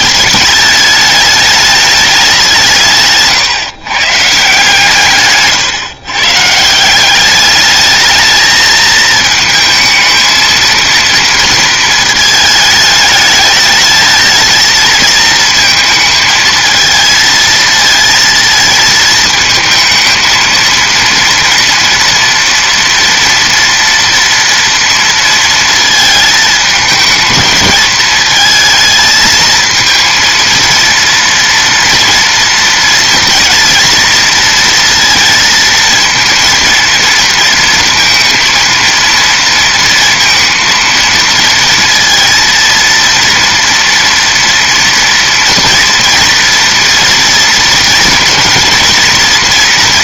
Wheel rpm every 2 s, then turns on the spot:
210, 170, 150, 180, 220, 230, 210, 220, 220, 220, 230, 230, 230, 220, 220, 230, 230, 230, 230, 230, 230, 230, 230, 230, 230.
none